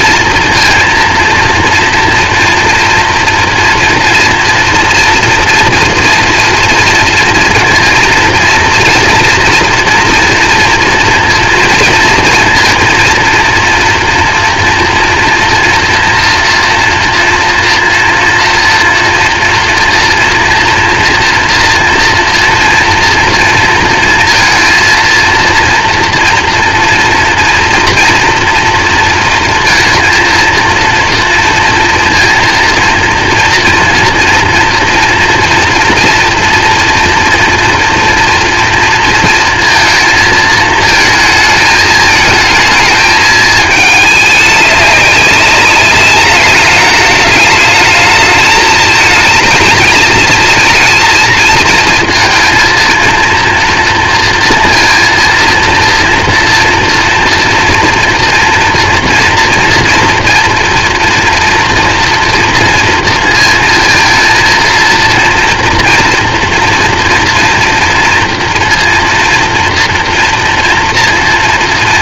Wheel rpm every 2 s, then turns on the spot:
230, 230, 230, 230, 230, 230, 230, 230, 230, 230, 230, 230, 230, 230, 230, 230, 230, 230, 230, 230, 220, 220, 200, 210, 210, 220, 230, 230, 230, 240, 230, 230, 230, 230, 230, 230.
none